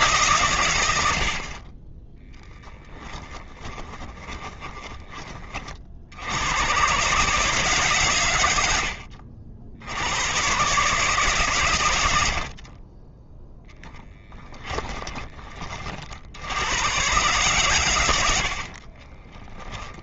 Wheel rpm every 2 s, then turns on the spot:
90, 10, 20, 130, 80, 130, 20, 20, 120, 30.
4-6 18-20